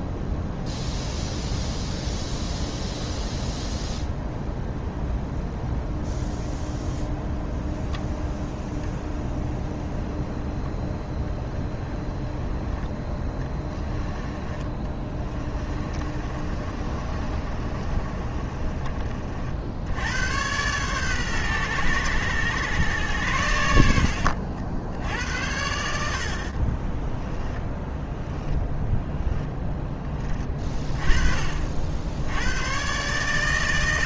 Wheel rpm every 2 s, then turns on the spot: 0, 0, 0, 0, 10, 0, 10, 20, 30, 30, 120, 110, 80, 30, 10, 20, 120.
14-18 26-28